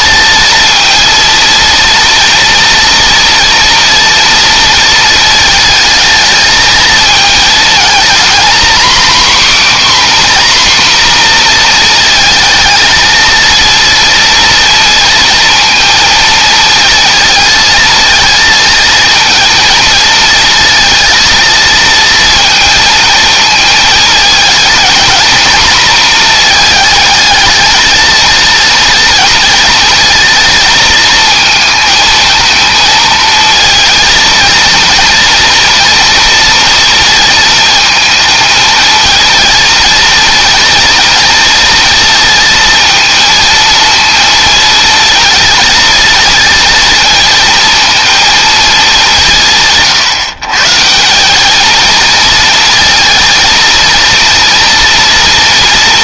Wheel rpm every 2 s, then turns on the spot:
230, 230, 230, 220, 270, 250, 220, 230, 220, 230, 230, 220, 230, 220, 230, 230, 230, 230, 230, 220, 230, 230, 230, 230, 190, 160, 230, 230.
none